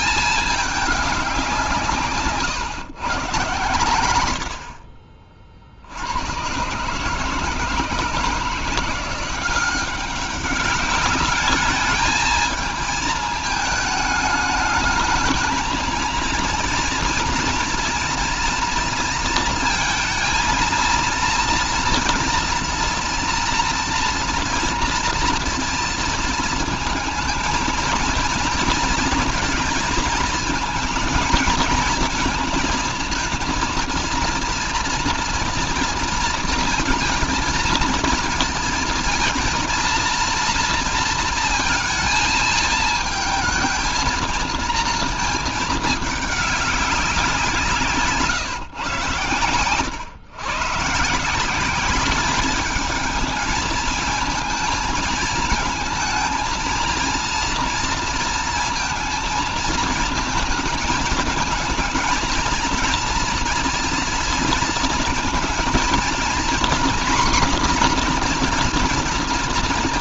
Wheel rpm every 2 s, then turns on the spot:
210, 130, 50, 140, 170, 200, 220, 210, 230, 230, 230, 230, 230, 220, 230, 220, 230, 240, 230, 230, 230, 220, 220, 190, 120, 140, 220, 220, 230, 230, 220, 230, 230, 240, 230.
none